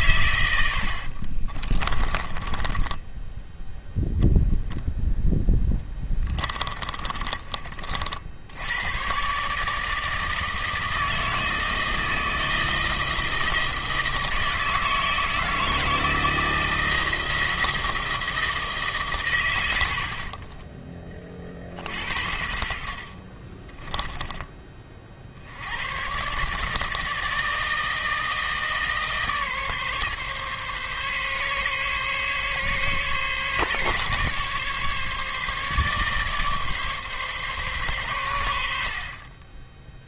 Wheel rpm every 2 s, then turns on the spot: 90, 20, 0, 30, 100, 160, 160, 160, 160, 150, 20, 60, 30, 150, 160, 140, 140, 140, 140, 60.
2-4 6-8